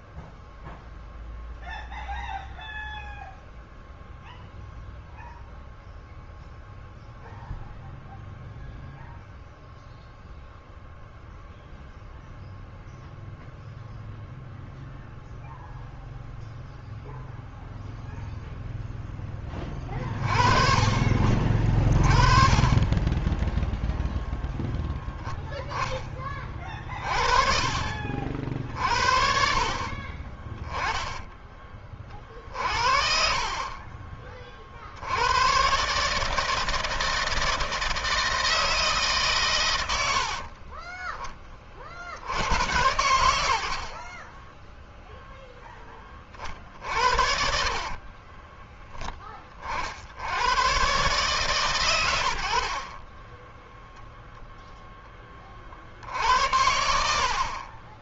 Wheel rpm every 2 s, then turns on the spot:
0, 0, 0, 0, 0, 0, 0, 0, 0, 10, 30, 20, 0, 40, 40, 10, 50, 70, 160, 140, 10, 90, 0, 50, 20, 130, 40, 10, 60.
46-48 52-54